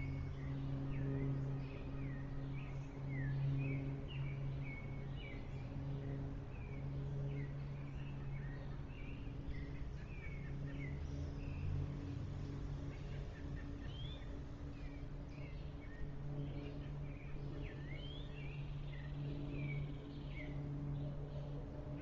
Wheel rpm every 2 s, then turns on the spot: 0, 0, 0, 0, 0, 0, 0, 0, 0, 0, 0.
none